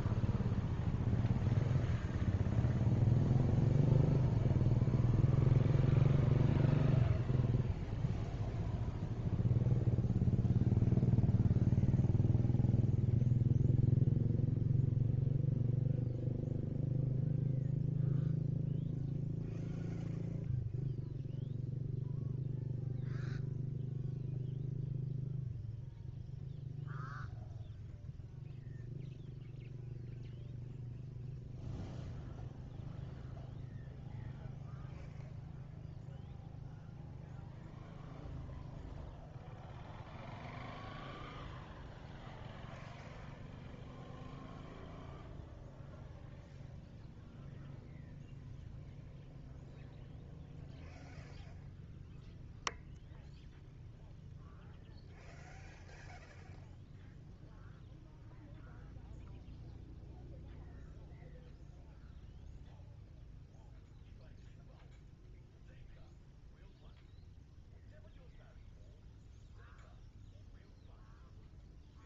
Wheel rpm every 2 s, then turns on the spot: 0, 0, 0, 0, 0, 0, 0, 0, 0, 0, 0, 0, 0, 0, 0, 0, 0, 0, 0, 0, 0, 0, 0, 0, 0, 0, 0, 0, 0, 0, 0, 0, 0, 0, 0, 0.
none